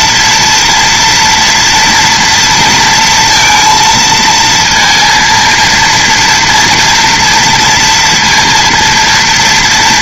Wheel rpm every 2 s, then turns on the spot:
230, 230, 220, 230, 230.
none